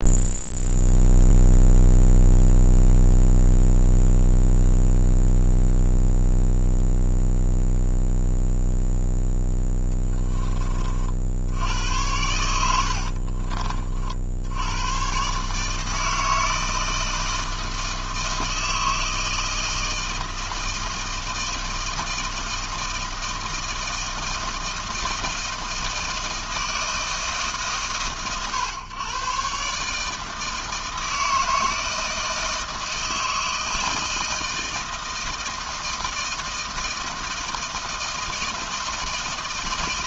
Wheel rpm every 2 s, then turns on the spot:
0, 0, 0, 0, 0, 40, 70, 110, 160, 160, 160, 160, 160, 160, 120, 160, 160, 160, 160, 160.
none